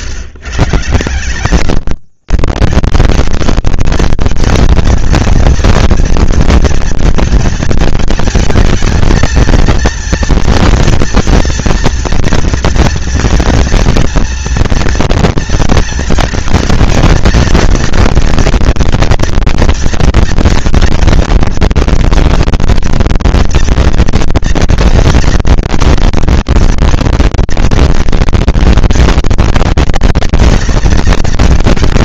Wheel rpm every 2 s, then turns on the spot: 130, 160, 230, 230, 220, 230, 230, 230, 220, 230, 230, 230, 230, 230, 230, 230.
none